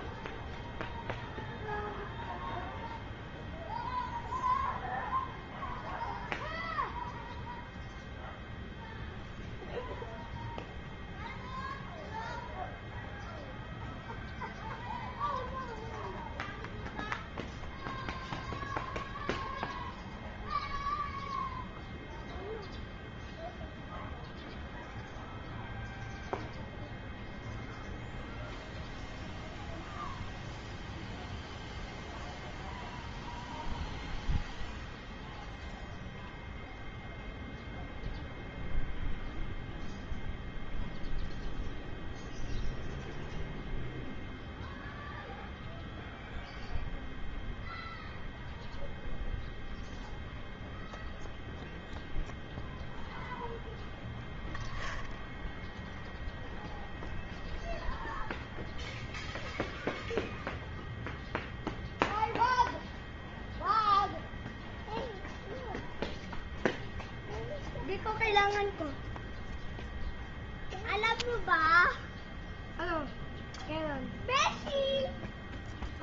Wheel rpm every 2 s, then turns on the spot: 0, 0, 0, 0, 0, 0, 0, 0, 0, 0, 0, 0, 0, 0, 0, 0, 0, 0, 0, 0, 0, 0, 0, 0, 0, 0, 0, 0, 0, 0, 0, 0, 0, 0, 0, 0, 0, 0.
none